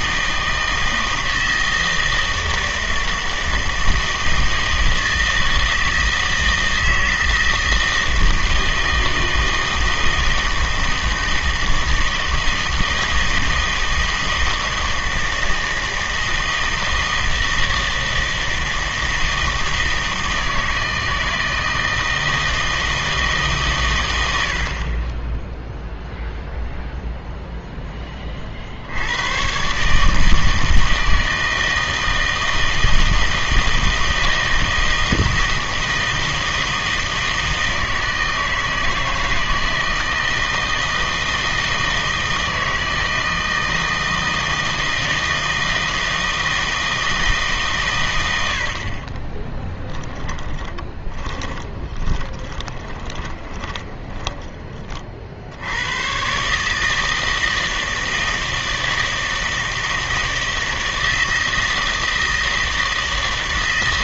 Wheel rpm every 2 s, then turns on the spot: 160, 160, 160, 160, 160, 160, 160, 160, 160, 160, 160, 160, 60, 0, 50, 160, 160, 160, 160, 160, 160, 160, 160, 160, 70, 20, 20, 20, 150, 160, 160, 160.
50-54